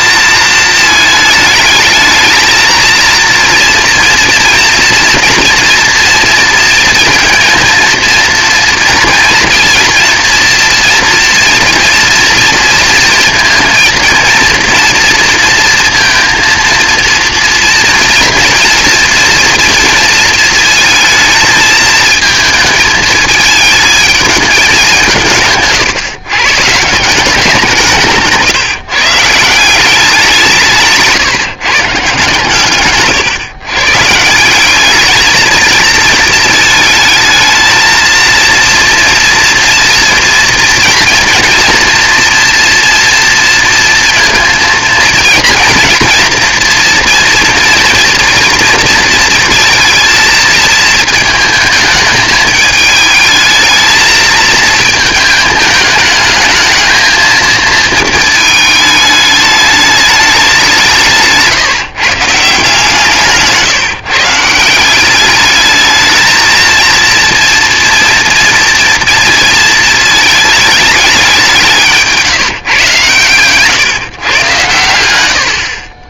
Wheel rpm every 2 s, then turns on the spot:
220, 230, 240, 230, 230, 240, 230, 230, 230, 230, 220, 220, 190, 160, 160, 170, 140, 200, 220, 230, 230, 240, 230, 230, 230, 220, 210, 220, 220, 220, 180, 150, 170, 230, 230, 210, 140, 110.
none